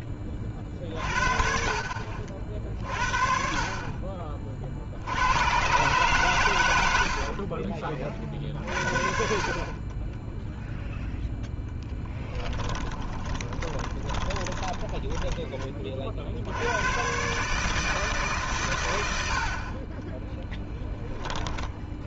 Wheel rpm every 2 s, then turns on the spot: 30, 30, 80, 90, 40, 0, 20, 20, 110, 100, 10.
12-16 20-22